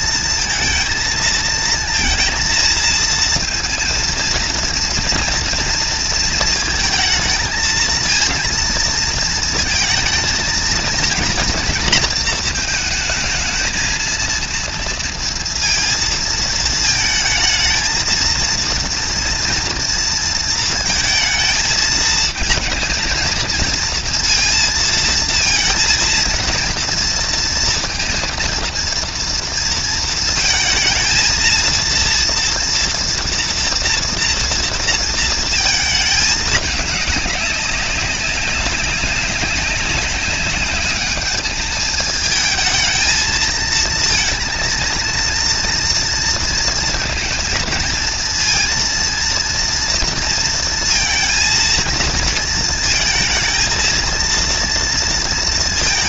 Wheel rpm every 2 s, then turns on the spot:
230, 230, 230, 230, 230, 230, 220, 230, 230, 220, 230, 230, 230, 230, 230, 220, 230, 230, 210, 200, 210, 220, 230, 230, 230, 230, 220, 230.
none